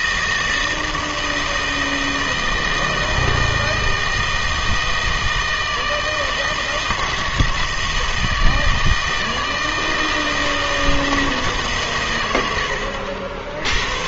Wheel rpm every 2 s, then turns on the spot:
160, 160, 160, 160, 160, 160, 80.
none